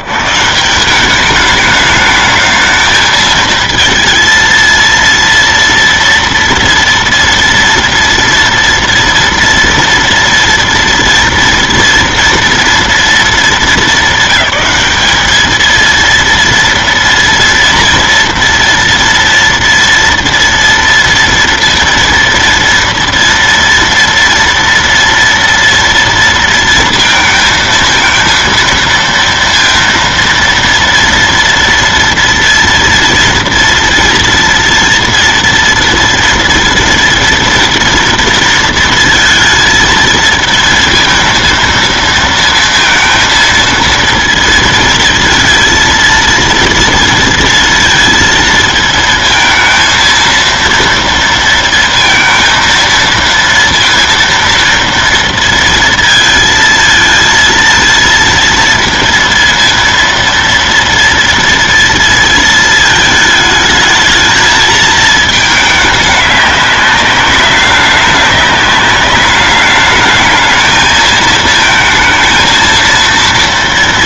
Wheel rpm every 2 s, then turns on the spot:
130, 210, 230, 230, 230, 240, 230, 200, 230, 230, 230, 230, 230, 230, 230, 230, 230, 230, 230, 230, 220, 230, 230, 230, 230, 230, 230, 230, 230, 230, 230, 230, 220, 210, 200, 210, 220.
none